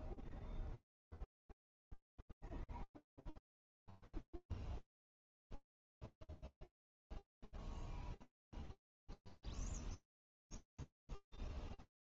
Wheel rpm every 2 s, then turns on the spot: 0, 0, 0, 0, 0, 0.
none